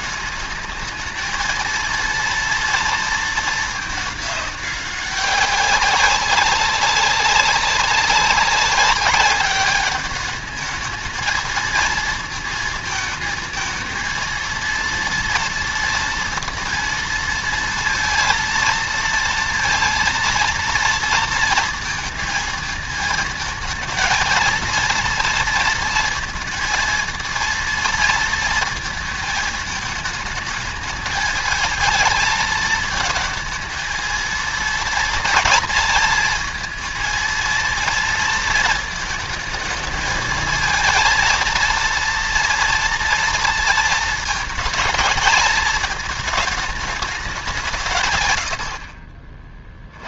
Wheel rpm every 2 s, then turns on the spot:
220, 230, 200, 190, 200, 220, 220, 230, 230, 230, 230, 220, 230, 230, 230, 220, 220, 230, 220, 220, 220, 240, 220, 220, 70.
none